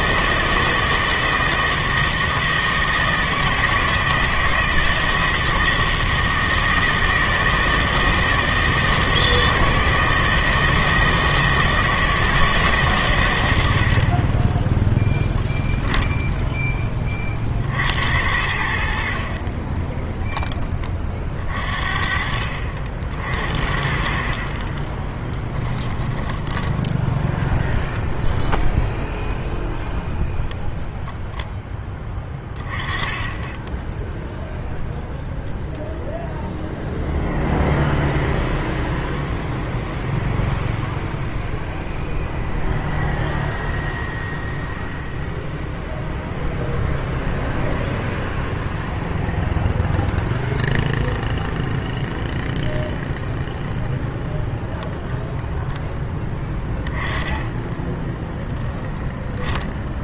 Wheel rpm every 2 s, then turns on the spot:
160, 160, 160, 160, 160, 160, 150, 20, 10, 80, 20, 60, 20, 10, 0, 0, 20, 0, 0, 0, 0, 0, 0, 0, 0, 0, 0, 10, 10, 0.
24-28 32-34 54-56